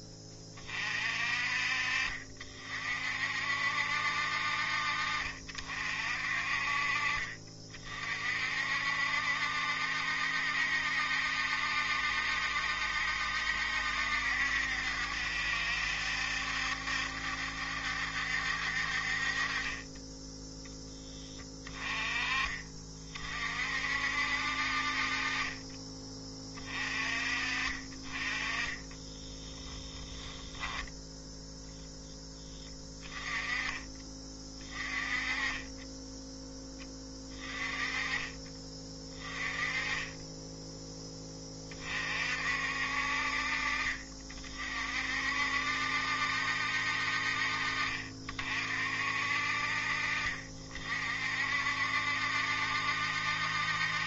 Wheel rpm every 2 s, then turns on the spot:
40, 50, 50, 40, 60, 70, 70, 70, 70, 60, 10, 30, 40, 30, 20, 0, 10, 20, 10, 20, 10, 60, 50, 60, 50, 40, 70.
28-30